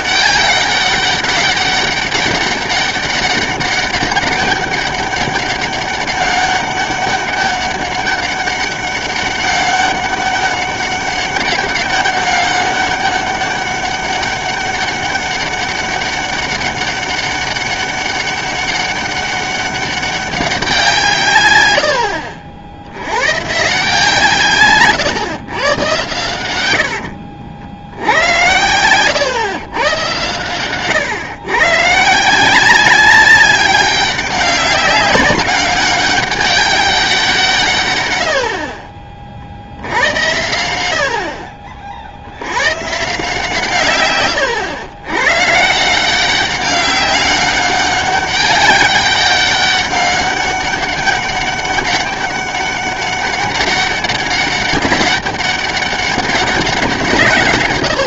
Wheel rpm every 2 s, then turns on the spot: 200, 200, 200, 200, 200, 200, 200, 200, 200, 200, 190, 70, 130, 90, 110, 120, 180, 200, 200, 50, 90, 120, 110, 190, 200, 200, 200, 200, 180.
26-30